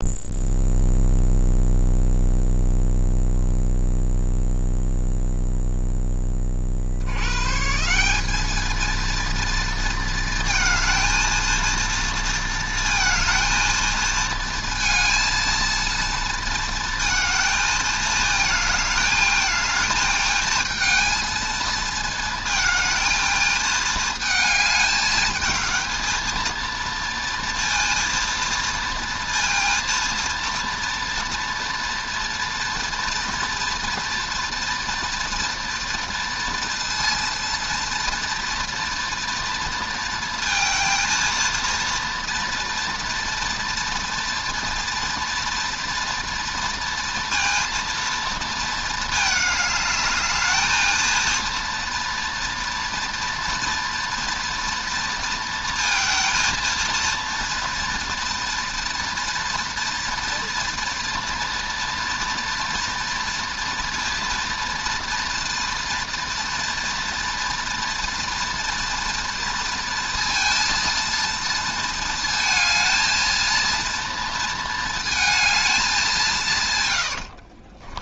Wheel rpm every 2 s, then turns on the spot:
0, 0, 0, 90, 230, 230, 230, 230, 220, 220, 230, 220, 210, 230, 230, 230, 230, 230, 230, 230, 230, 230, 240, 230, 220, 220, 240, 230, 230, 230, 230, 230, 230, 230, 230, 230, 230, 220, 100.
76-78